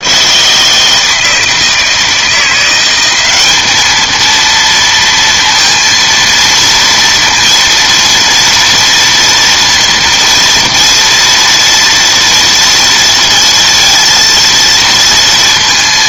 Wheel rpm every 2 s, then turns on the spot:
160, 190, 230, 230, 230, 230, 230, 230.
none